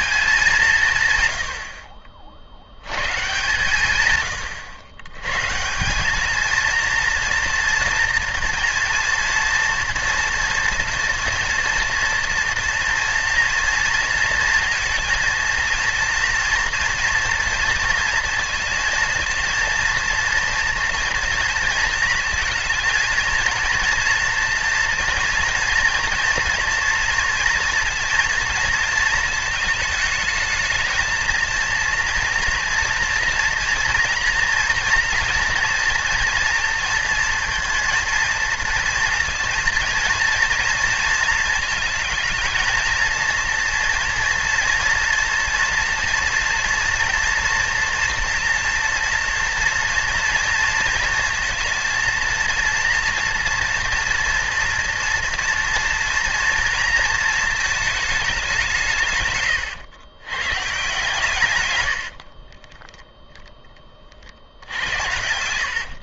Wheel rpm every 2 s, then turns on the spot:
150, 100, 100, 230, 230, 230, 230, 230, 230, 230, 230, 230, 230, 230, 220, 220, 230, 230, 230, 230, 230, 230, 230, 230, 230, 230, 230, 240, 230, 150, 140, 10, 70.
62-66